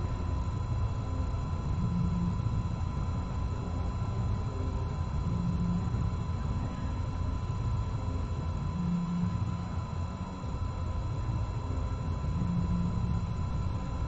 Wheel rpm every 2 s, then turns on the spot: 0, 0, 0, 0, 0, 0, 0.
none